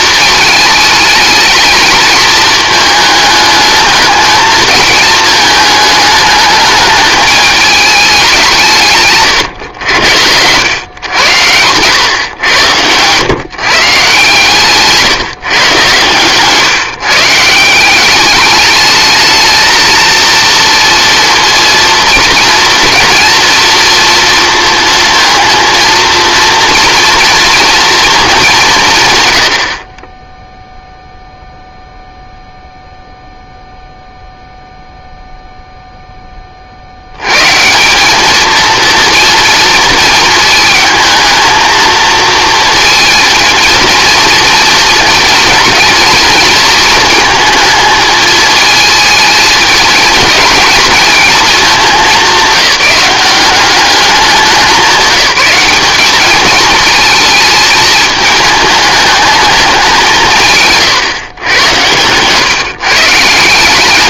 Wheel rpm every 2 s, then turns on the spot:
220, 220, 220, 220, 170, 110, 100, 150, 150, 210, 230, 230, 230, 230, 170, 0, 0, 0, 50, 230, 220, 230, 230, 230, 220, 220, 190, 190, 220, 220, 140, 140.
none